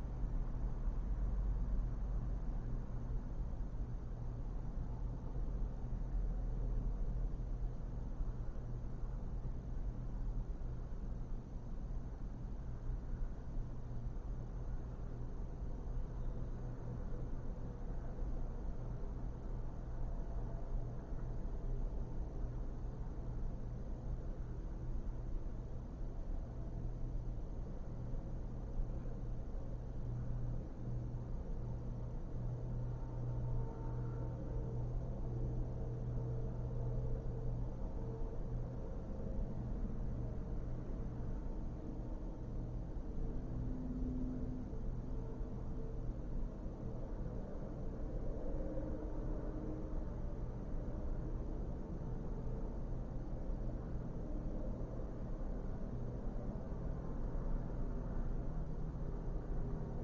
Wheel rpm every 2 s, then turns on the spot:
0, 0, 0, 0, 0, 0, 0, 0, 0, 0, 0, 0, 0, 0, 0, 0, 0, 0, 0, 0, 0, 0, 0, 0, 0, 0, 0, 0, 0, 0.
none